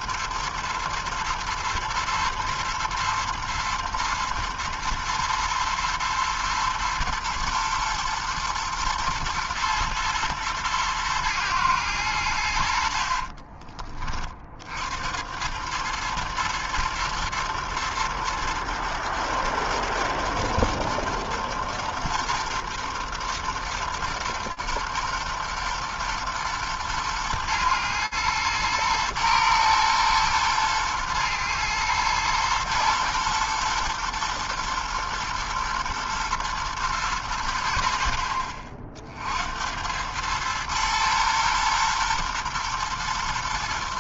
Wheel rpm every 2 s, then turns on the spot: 110, 110, 110, 110, 110, 120, 90, 40, 110, 120, 120, 120, 120, 120, 110, 120, 110, 110, 120, 50, 110, 120.
none